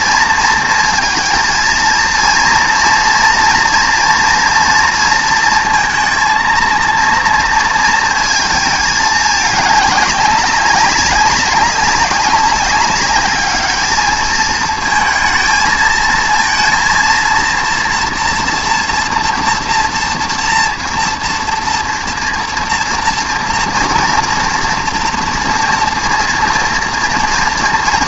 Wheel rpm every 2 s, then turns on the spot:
230, 230, 230, 230, 220, 200, 200, 220, 230, 230, 230, 230, 230, 230.
none